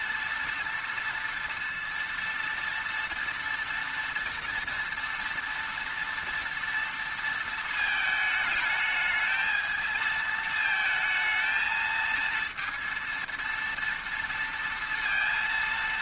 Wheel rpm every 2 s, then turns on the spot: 230, 230, 230, 230, 220, 220, 230, 230.
none